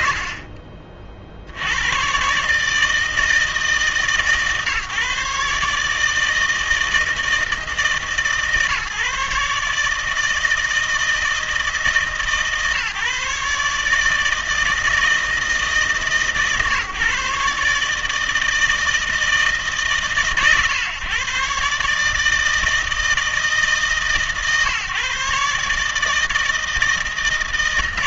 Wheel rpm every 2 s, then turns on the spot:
60, 140, 140, 160, 150, 160, 140, 160, 140, 160, 130, 160, 150, 160.
0-2